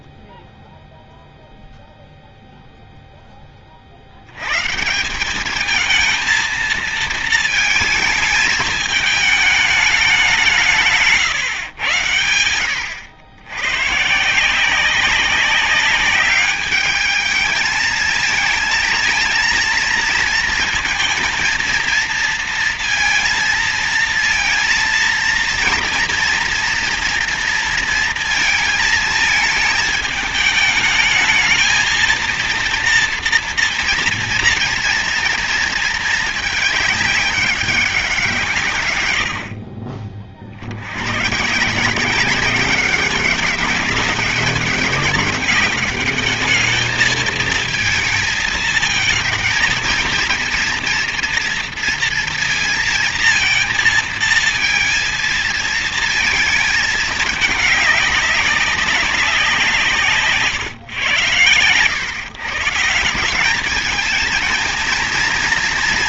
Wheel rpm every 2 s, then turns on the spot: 0, 0, 140, 230, 220, 160, 90, 190, 210, 230, 230, 230, 230, 230, 220, 210, 230, 230, 210, 130, 80, 200, 200, 220, 230, 230, 230, 230, 220, 190, 120, 150, 230.
10-12